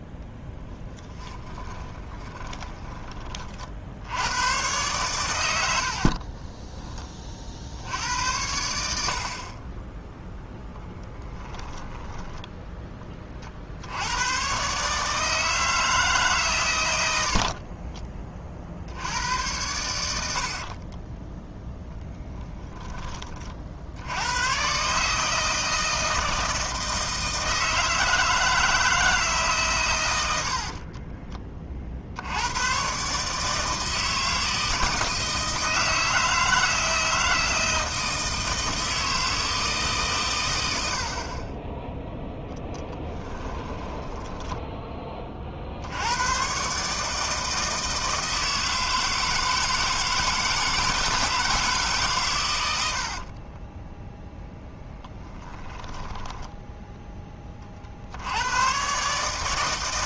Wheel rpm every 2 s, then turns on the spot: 10, 30, 120, 20, 80, 10, 10, 140, 110, 60, 40, 20, 130, 160, 160, 40, 130, 160, 160, 160, 70, 10, 10, 140, 160, 160, 80, 10, 10, 120.
0-4 10-12 20-22 30-32 42-44 52-56